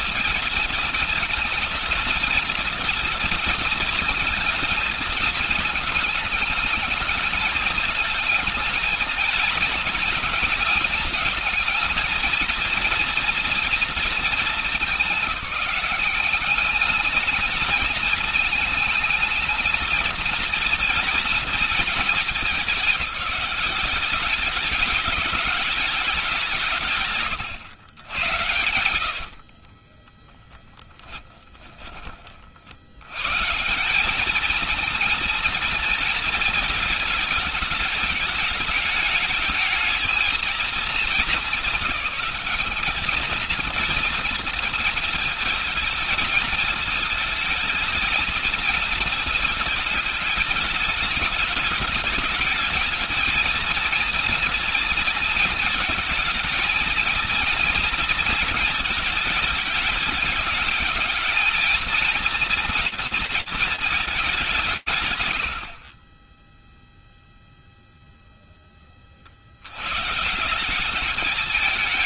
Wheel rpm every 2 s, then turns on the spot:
230, 230, 220, 210, 220, 220, 230, 210, 200, 220, 230, 210, 200, 160, 80, 20, 70, 220, 220, 210, 220, 210, 230, 220, 220, 210, 220, 230, 220, 230, 220, 230, 140, 0, 50, 210.
28-32